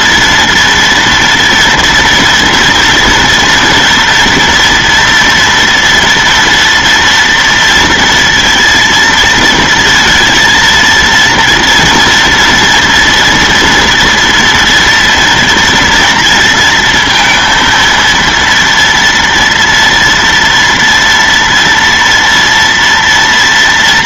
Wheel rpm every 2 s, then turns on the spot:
230, 230, 240, 230, 230, 230, 230, 230, 230, 230, 230, 230.
none